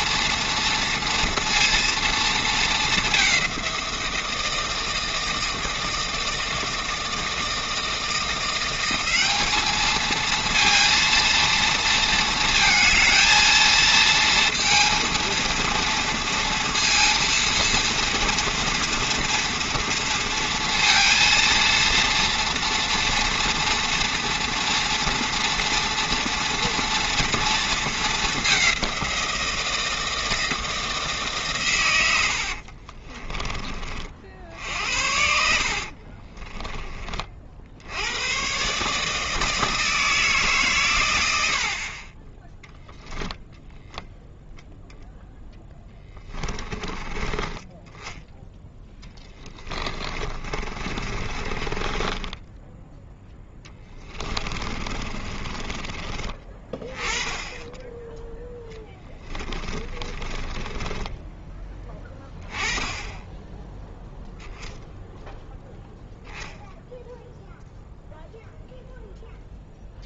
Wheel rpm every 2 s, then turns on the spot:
230, 220, 160, 160, 180, 230, 230, 230, 230, 230, 230, 230, 240, 230, 200, 160, 50, 60, 30, 140, 130, 10, 0, 20, 20, 40, 10, 30, 20, 10, 10, 10, 0, 0, 0.
32-34 36-38 48-56 58-62